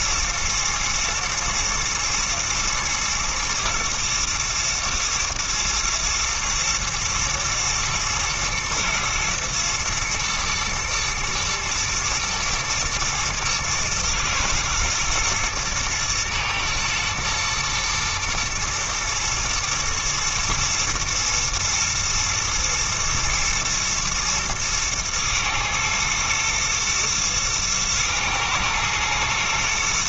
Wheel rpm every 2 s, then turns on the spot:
120, 120, 110, 120, 110, 110, 110, 110, 110, 110, 120, 110, 110, 110, 110.
none